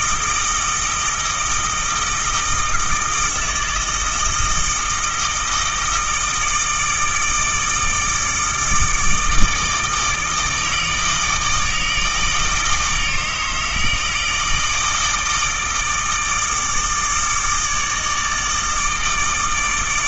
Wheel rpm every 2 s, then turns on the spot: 160, 160, 160, 160, 160, 160, 150, 160, 160, 160.
none